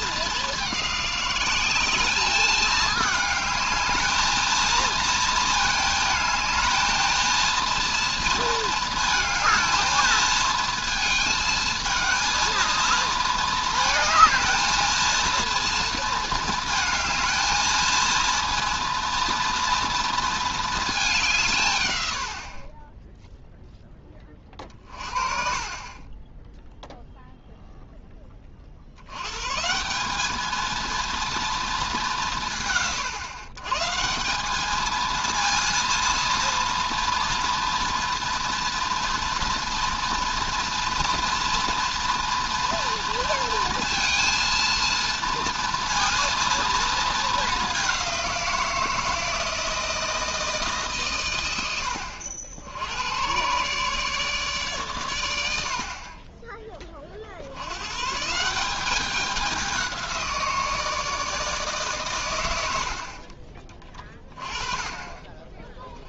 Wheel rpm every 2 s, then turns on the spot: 200, 210, 230, 220, 230, 230, 230, 220, 220, 230, 220, 40, 30, 0, 50, 220, 150, 210, 230, 230, 230, 230, 230, 230, 170, 150, 80, 130, 20, 180, 170, 80, 30.
none